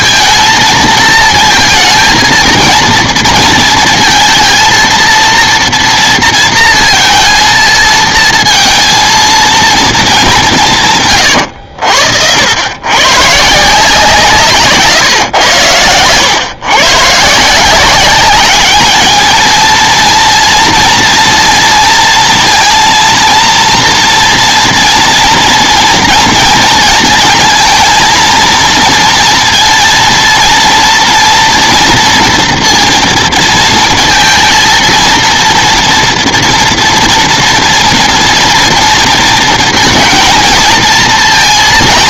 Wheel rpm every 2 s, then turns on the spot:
220, 230, 230, 230, 230, 180, 100, 140, 120, 210, 230, 230, 230, 230, 230, 230, 230, 230, 230, 230, 220.
none